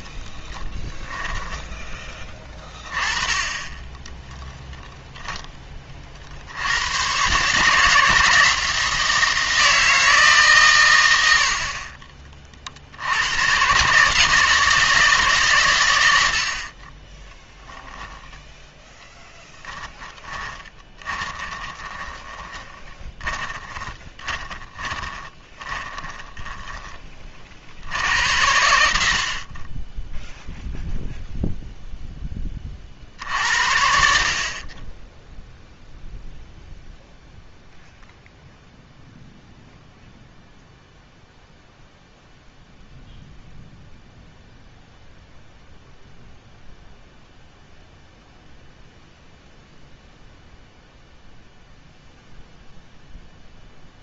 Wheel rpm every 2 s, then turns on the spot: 10, 20, 0, 90, 170, 120, 60, 160, 30, 10, 20, 20, 20, 20, 80, 0, 40, 30, 0, 0, 0, 0, 0, 0, 0, 0, 0.
20-26